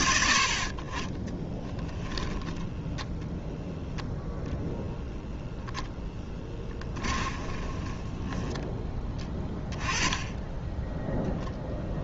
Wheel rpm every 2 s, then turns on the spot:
70, 10, 0, 10, 10, 10.
6-8